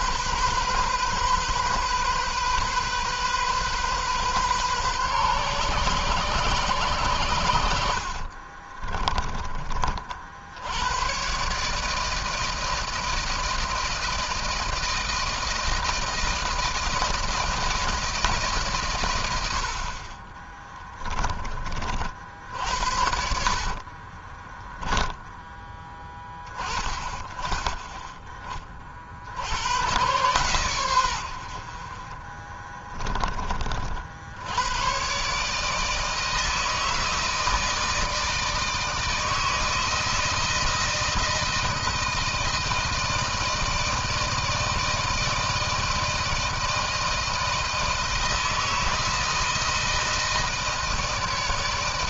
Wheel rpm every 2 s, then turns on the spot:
130, 130, 130, 110, 30, 100, 160, 160, 160, 130, 20, 60, 10, 20, 40, 110, 20, 110, 160, 160, 170, 160, 160, 160, 160, 160.
8-10 20-26 32-34